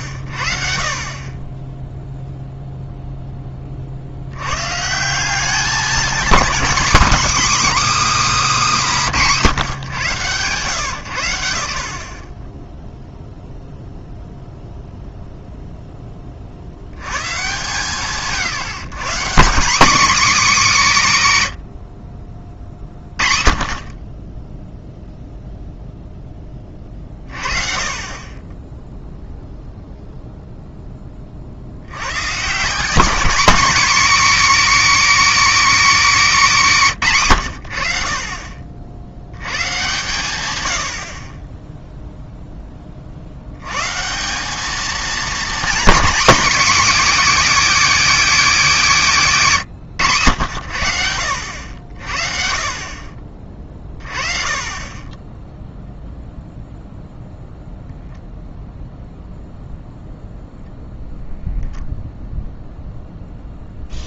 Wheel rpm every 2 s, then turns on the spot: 30, 0, 160, 250, 260, 120, 10, 0, 40, 150, 200, 50, 0, 10, 10, 0, 170, 270, 200, 50, 100, 0, 190, 260, 230, 90, 40, 30, 0, 0, 0, 0.
none